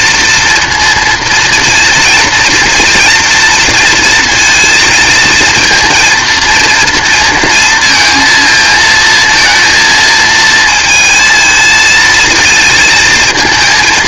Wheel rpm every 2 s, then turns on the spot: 230, 230, 230, 230, 220, 220, 220.
none